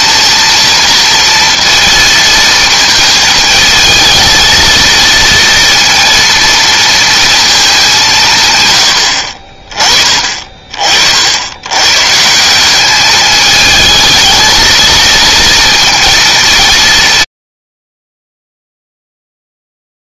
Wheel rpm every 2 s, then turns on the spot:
230, 220, 220, 230, 120, 40, 190, 220, 170, 0.
none